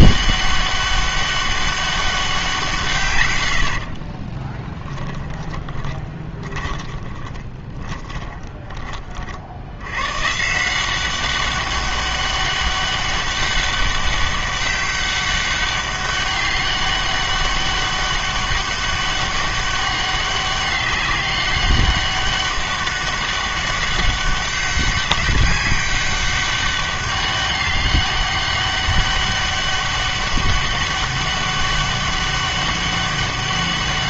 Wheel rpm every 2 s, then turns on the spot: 200, 170, 10, 20, 20, 170, 200, 200, 200, 200, 200, 200, 200, 200, 200, 200, 200.
4-8